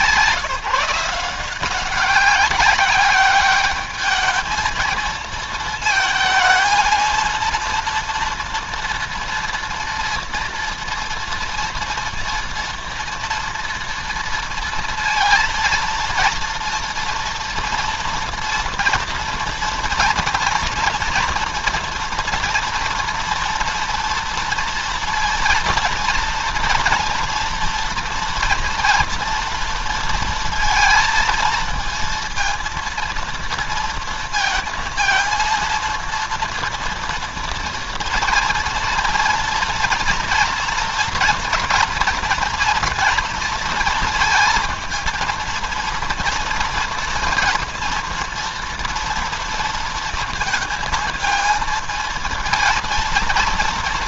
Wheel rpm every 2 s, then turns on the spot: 160, 190, 220, 220, 230, 230, 230, 230, 230, 230, 230, 230, 230, 230, 240, 230, 230, 230, 240, 240, 230, 240, 230, 230, 230, 230, 230.
none